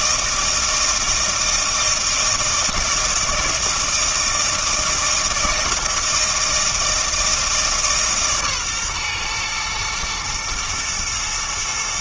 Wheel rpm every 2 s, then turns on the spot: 160, 160, 160, 160, 140, 120.
none